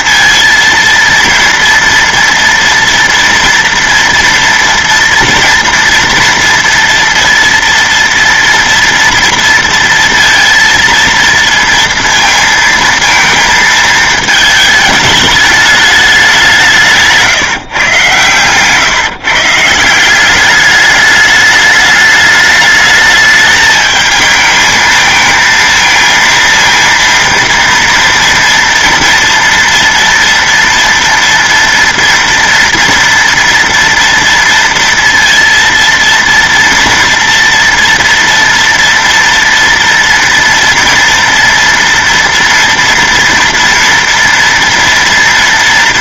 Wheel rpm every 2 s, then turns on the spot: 230, 230, 230, 230, 230, 230, 230, 220, 180, 130, 200, 210, 220, 230, 230, 230, 230, 230, 230, 230, 230, 230, 230.
none